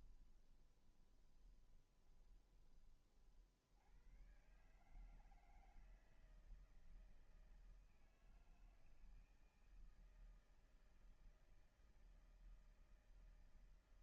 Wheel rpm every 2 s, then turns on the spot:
10, 20, 100, 160, 160, 160, 160.
0-4